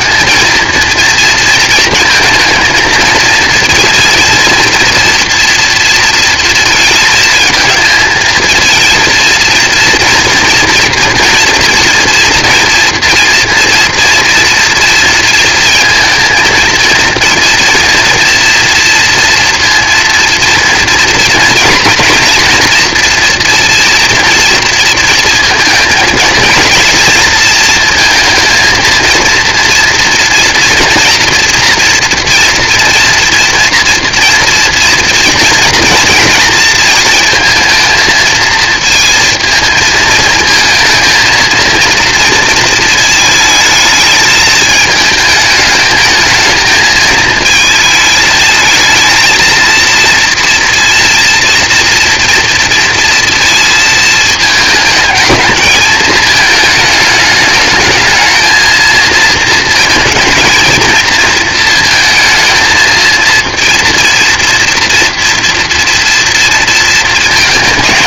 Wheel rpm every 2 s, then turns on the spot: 230, 230, 230, 230, 230, 230, 230, 230, 220, 230, 230, 240, 230, 230, 230, 230, 230, 230, 230, 230, 220, 230, 220, 220, 220, 240, 230, 220, 220, 220, 230, 220, 230, 230.
none